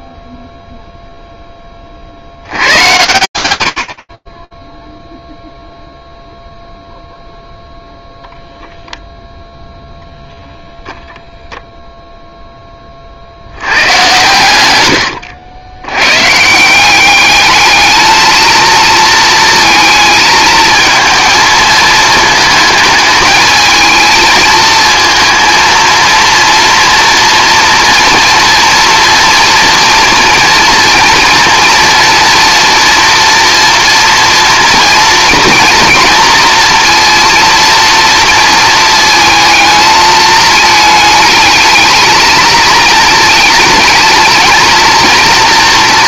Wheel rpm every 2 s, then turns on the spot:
0, 120, 10, 0, 0, 0, 70, 80, 210, 230, 220, 220, 230, 230, 240, 230, 230, 230, 230, 220, 220, 230, 230.
4-6